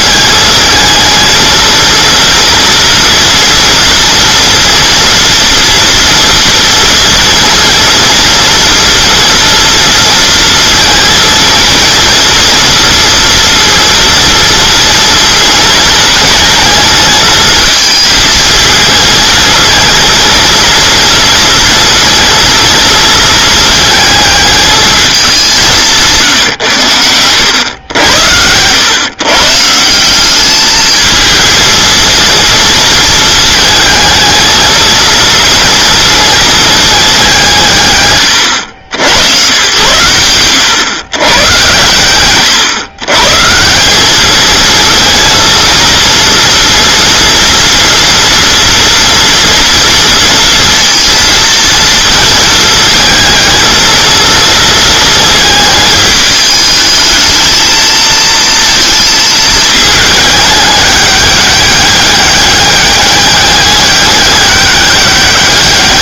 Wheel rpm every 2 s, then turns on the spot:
220, 230, 230, 230, 230, 230, 230, 230, 220, 220, 230, 230, 220, 110, 120, 210, 230, 230, 220, 80, 120, 120, 220, 230, 240, 230, 220, 230, 220, 230, 210, 200, 200.
none